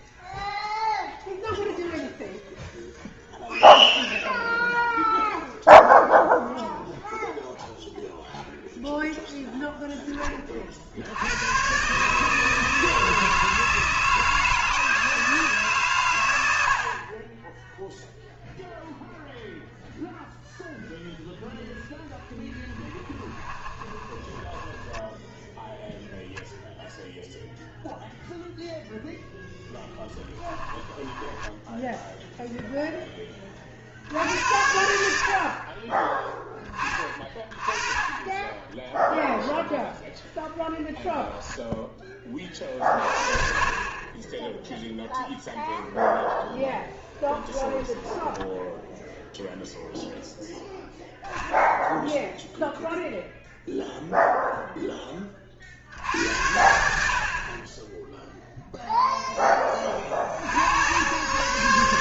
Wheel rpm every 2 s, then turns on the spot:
0, 0, 0, 0, 10, 90, 160, 160, 30, 0, 0, 10, 0, 0, 0, 10, 20, 60, 30, 0, 0, 40, 0, 10, 0, 0, 0, 10, 60, 0, 90.
22-24 30-32 46-48